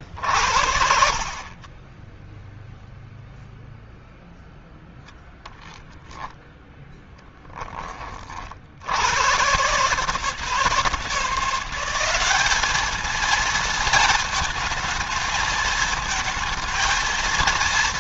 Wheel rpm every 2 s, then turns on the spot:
50, 0, 0, 10, 80, 160, 210, 230, 230.
6-8